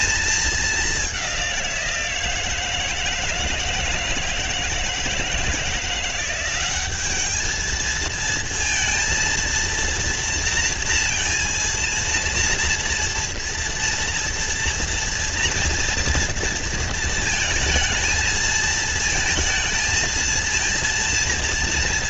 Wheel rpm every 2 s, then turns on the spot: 210, 160, 170, 190, 230, 230, 230, 240, 230, 220, 230.
none